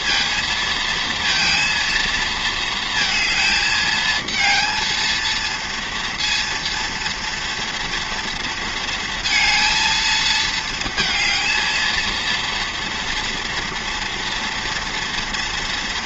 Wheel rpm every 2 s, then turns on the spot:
230, 230, 220, 230, 230, 220, 230, 230.
none